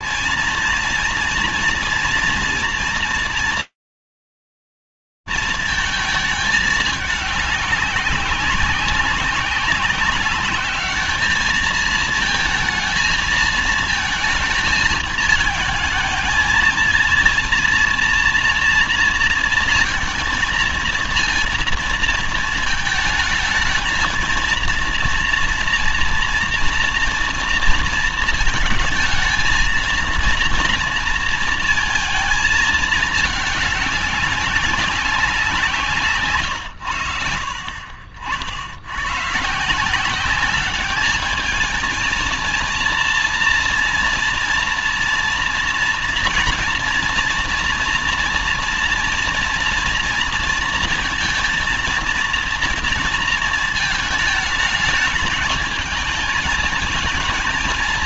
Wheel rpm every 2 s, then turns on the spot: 230, 230, 210, 200, 200, 220, 220, 220, 230, 220, 220, 230, 240, 230, 230, 220, 200, 150, 60, 180, 230, 230, 230, 240, 230, 230, 220, 220, 220.
none